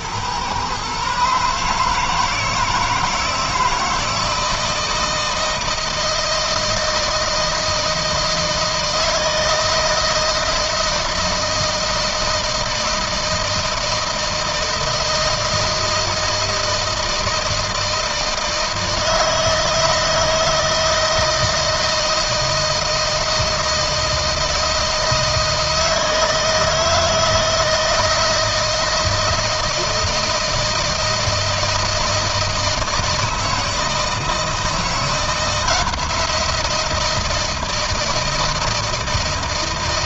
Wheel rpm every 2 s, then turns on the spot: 130, 160, 160, 160, 160, 160, 160, 160, 160, 160, 160, 160, 160, 160, 160, 160, 160, 160, 170, 160.
none